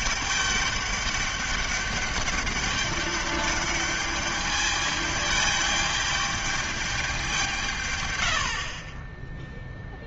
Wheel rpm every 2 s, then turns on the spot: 200, 200, 210, 210, 60.
none